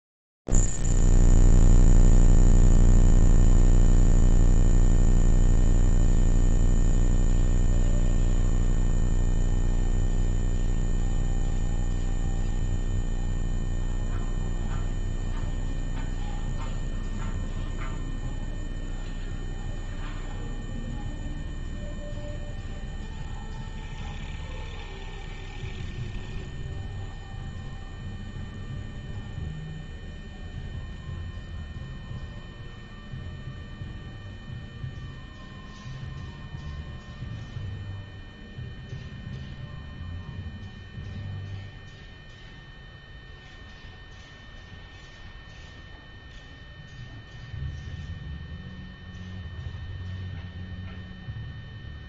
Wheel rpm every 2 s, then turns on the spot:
0, 0, 0, 0, 0, 0, 0, 0, 0, 0, 0, 0, 0, 0, 0, 0, 0, 0, 0, 0, 0, 0, 0, 0, 0, 0.
none